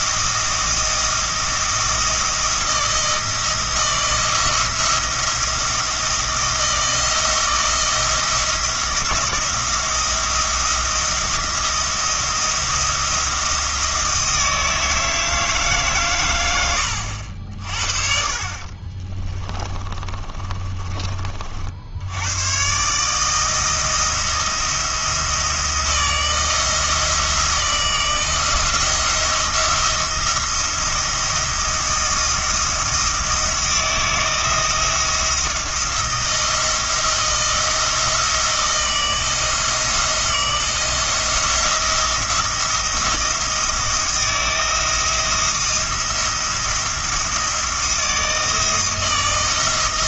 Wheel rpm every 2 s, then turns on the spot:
170, 160, 170, 170, 160, 170, 170, 160, 90, 50, 30, 130, 170, 160, 170, 170, 170, 170, 160, 160, 170, 170, 170, 170, 160.
18-22